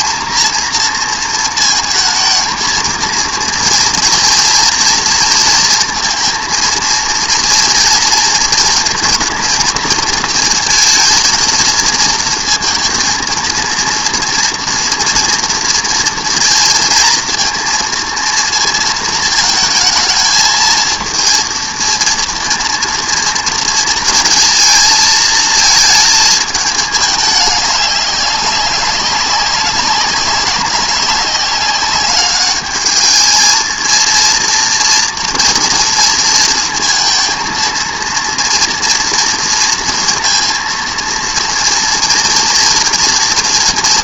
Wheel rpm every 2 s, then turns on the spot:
230, 220, 230, 230, 230, 220, 230, 230, 230, 230, 220, 230, 230, 220, 200, 190, 210, 230, 230, 230, 230, 230.
none